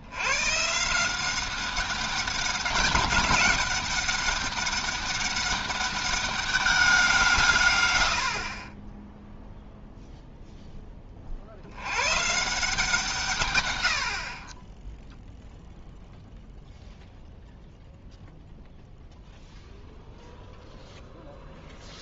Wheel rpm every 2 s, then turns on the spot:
140, 190, 200, 200, 30, 10, 170, 10, 0, 0, 0.
none